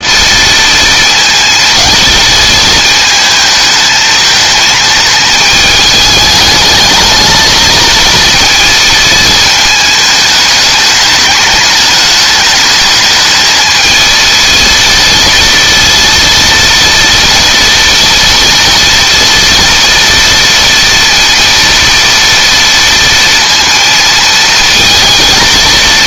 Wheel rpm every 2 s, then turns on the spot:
230, 220, 220, 210, 230, 210, 210, 230, 230, 230, 230, 230, 230.
none